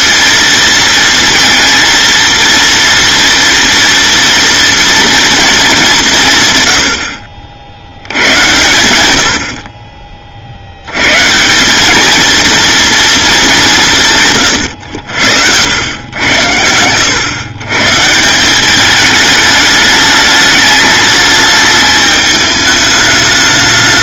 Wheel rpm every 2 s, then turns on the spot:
230, 230, 230, 90, 110, 110, 230, 80, 110, 210, 210, 210.
none